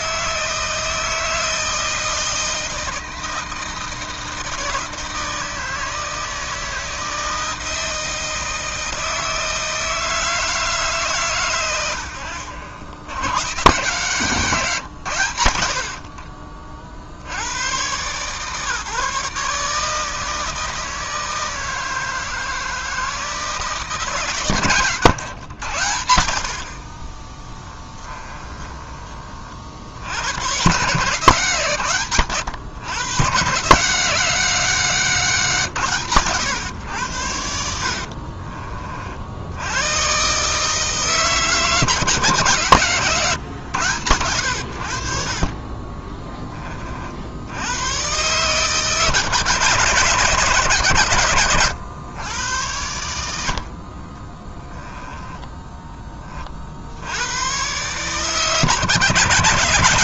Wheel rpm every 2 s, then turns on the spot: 160, 160, 160, 160, 160, 150, 80, 150, 40, 140, 160, 160, 130, 40, 20, 120, 110, 180, 120, 40, 150, 130, 70, 30, 140, 130, 100, 10, 70, 150.
26-30 54-56